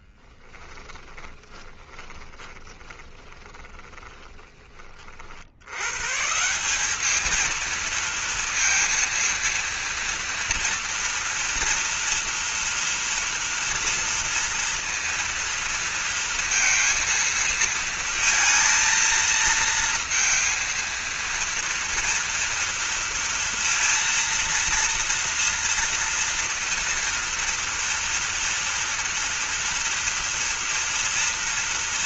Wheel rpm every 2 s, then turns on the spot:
20, 20, 30, 190, 230, 230, 230, 230, 230, 230, 230, 230, 230, 230, 240, 230.
0-4